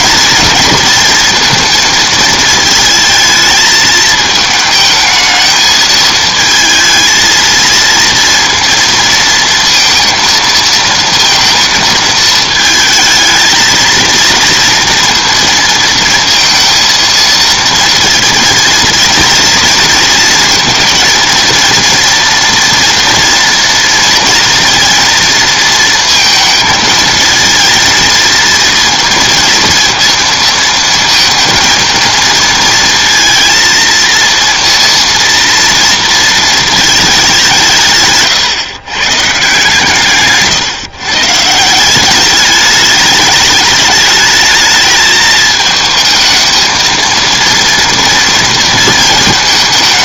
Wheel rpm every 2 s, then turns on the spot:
230, 220, 220, 220, 230, 230, 220, 230, 230, 220, 230, 230, 230, 220, 230, 220, 230, 230, 220, 120, 140, 210, 220, 220, 230.
none